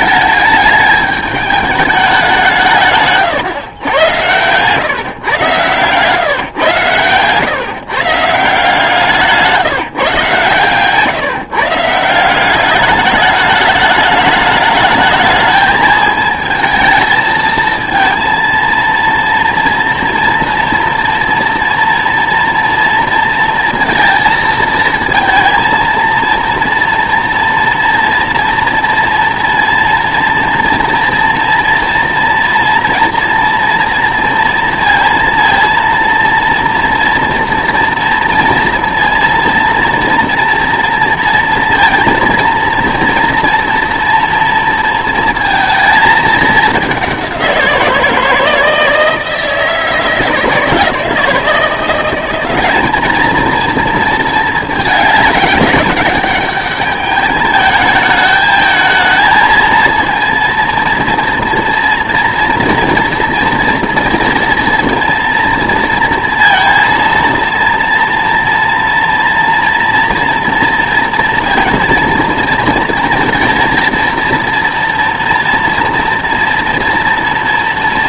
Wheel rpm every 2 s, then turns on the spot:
210, 150, 130, 130, 170, 140, 200, 220, 220, 230, 230, 230, 220, 230, 230, 230, 230, 230, 230, 230, 230, 230, 230, 210, 170, 170, 210, 210, 210, 220, 230, 240, 230, 230, 240, 230, 230, 230, 230.
none